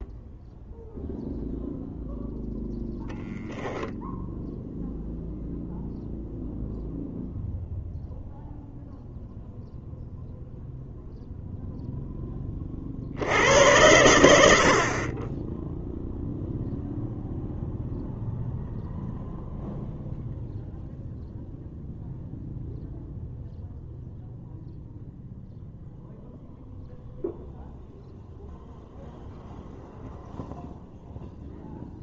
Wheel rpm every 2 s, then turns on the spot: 0, 0, 0, 0, 0, 0, 20, 60, 0, 0, 0, 0, 0, 0, 0, 0.
none